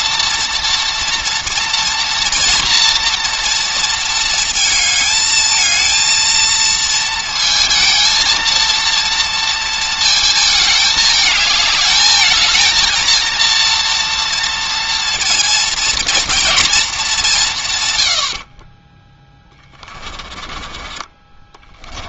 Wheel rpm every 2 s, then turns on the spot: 230, 230, 220, 230, 230, 220, 220, 230, 220, 30, 20.
18-22